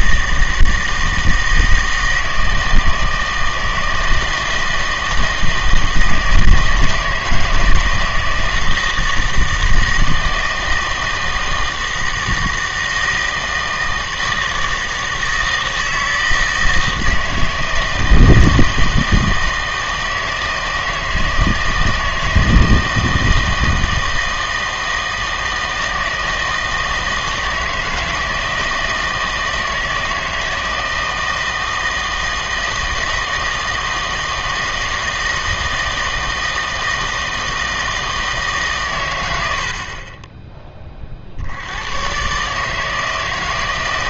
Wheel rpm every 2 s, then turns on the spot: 160, 160, 160, 160, 160, 160, 160, 160, 160, 160, 160, 160, 160, 160, 160, 160, 160, 160, 160, 140, 20, 150.
none